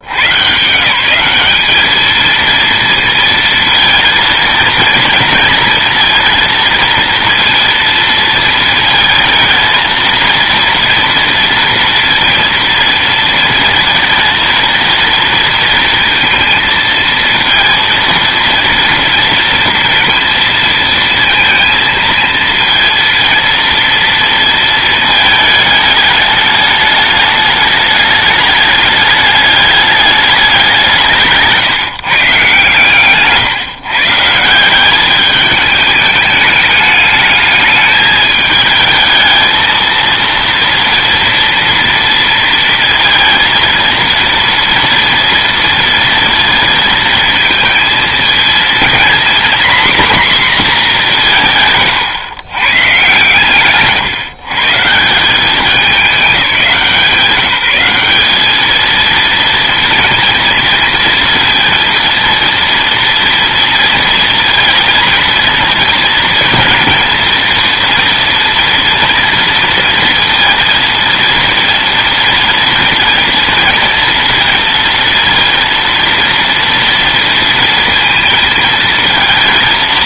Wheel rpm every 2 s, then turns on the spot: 150, 230, 230, 230, 230, 230, 230, 230, 230, 230, 230, 230, 220, 210, 210, 190, 160, 180, 210, 220, 230, 230, 240, 230, 230, 230, 120, 160, 180, 220, 230, 230, 230, 230, 230, 230, 230, 230, 230, 220.
none